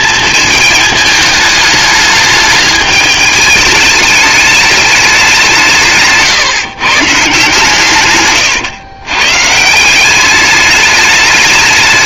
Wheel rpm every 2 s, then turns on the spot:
220, 210, 210, 140, 130, 210.
none